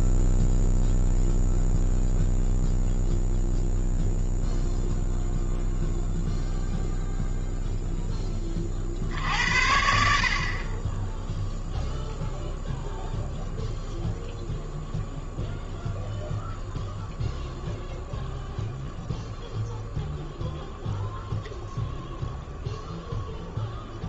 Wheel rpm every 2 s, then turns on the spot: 0, 0, 0, 0, 40, 30, 0, 0, 0, 0, 0, 0.
none